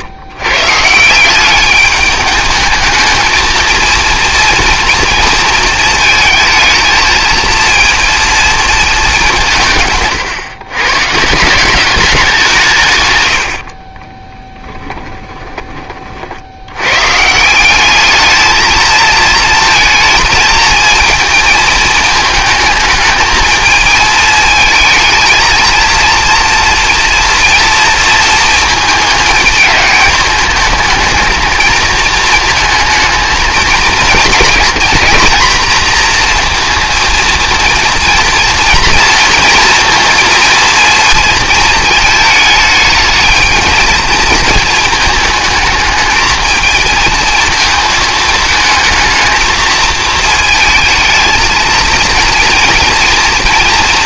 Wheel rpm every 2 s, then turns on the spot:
150, 220, 230, 220, 210, 130, 150, 20, 100, 220, 230, 220, 220, 230, 220, 220, 220, 240, 230, 230, 230, 220, 220, 220, 220, 220, 230.
14-16